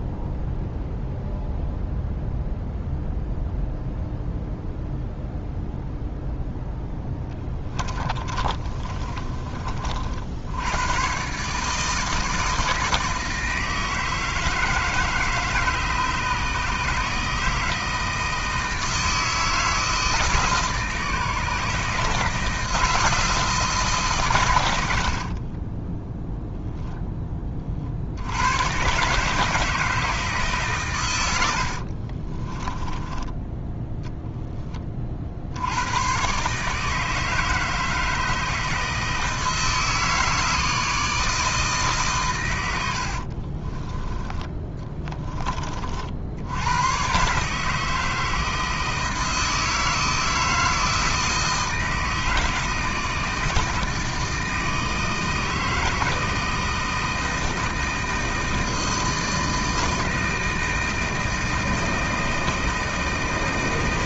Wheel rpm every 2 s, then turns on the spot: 0, 0, 0, 10, 30, 100, 160, 160, 150, 160, 150, 160, 90, 0, 120, 110, 20, 20, 150, 160, 160, 80, 20, 110, 160, 160, 160, 160, 160, 160, 160, 160.
6-10 32-34 44-46